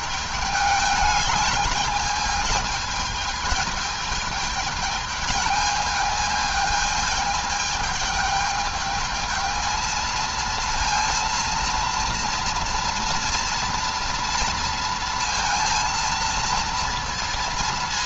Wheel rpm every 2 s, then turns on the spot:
210, 220, 220, 220, 210, 230, 230, 230, 230.
none